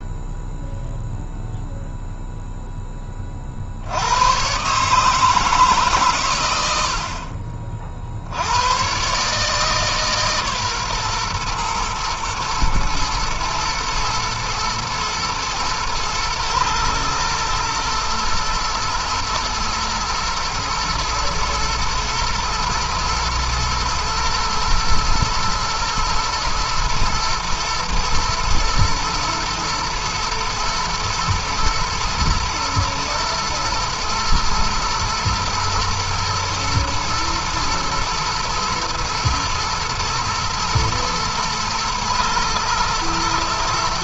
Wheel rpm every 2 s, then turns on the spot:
0, 10, 140, 80, 100, 130, 110, 120, 120, 120, 110, 110, 110, 120, 110, 110, 120, 110, 120, 110, 110, 120.
none